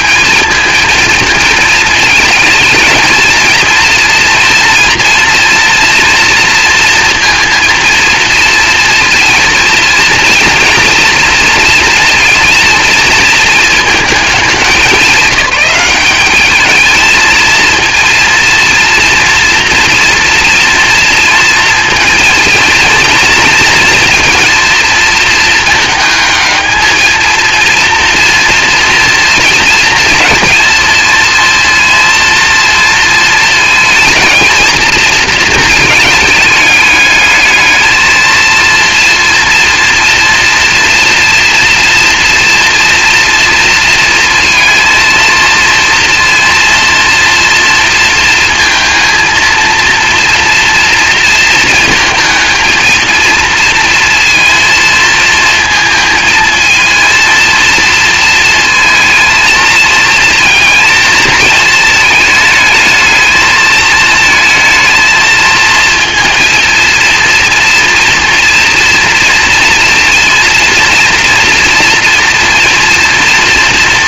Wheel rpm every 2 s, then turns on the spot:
220, 220, 240, 230, 230, 230, 230, 210, 210, 240, 230, 220, 230, 220, 230, 230, 230, 230, 210, 230, 230, 230, 230, 230, 230, 230, 220, 230, 230, 230, 220, 220, 230, 230, 230, 230, 240.
none